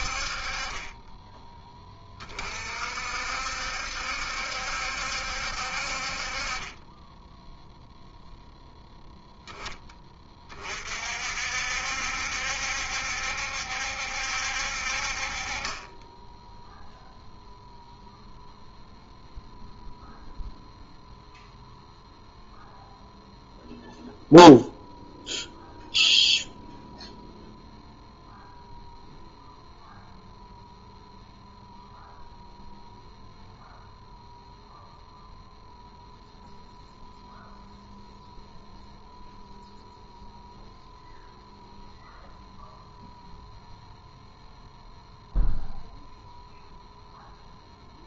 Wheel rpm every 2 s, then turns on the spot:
30, 50, 70, 20, 0, 40, 70, 60, 0, 0, 0, 0, 0, 0, 0, 0, 0, 0, 0, 0, 0, 0, 0, 0.
none